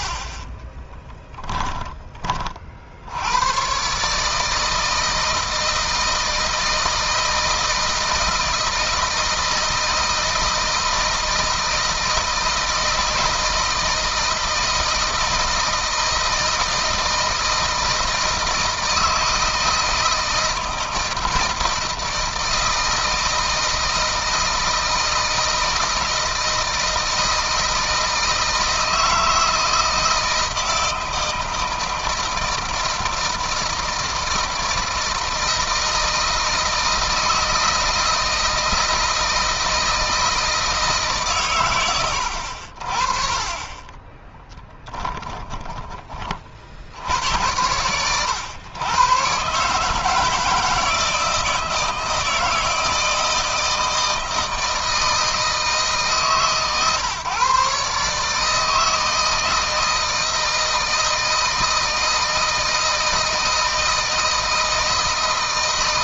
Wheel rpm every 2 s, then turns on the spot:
30, 70, 160, 160, 160, 160, 160, 160, 160, 160, 160, 160, 160, 160, 160, 170, 160, 160, 160, 160, 150, 40, 10, 60, 120, 160, 160, 160, 140, 160, 160, 160, 160.
0-2 44-46